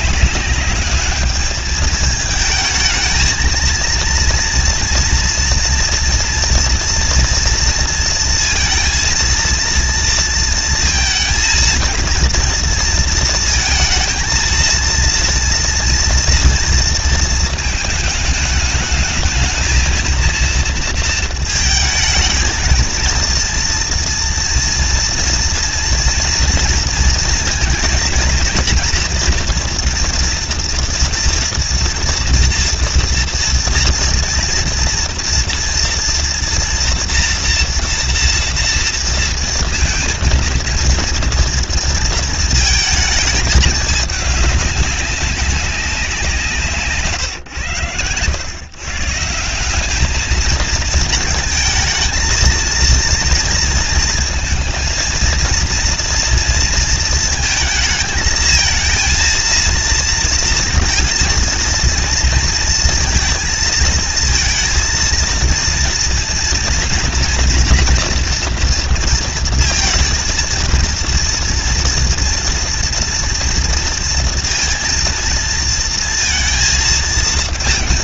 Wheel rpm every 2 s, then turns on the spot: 200, 220, 230, 230, 230, 230, 230, 230, 230, 210, 230, 230, 230, 240, 230, 230, 230, 230, 230, 230, 230, 220, 210, 180, 120, 220, 230, 230, 230, 220, 230, 230, 230, 230, 230, 230, 230, 230, 220.
none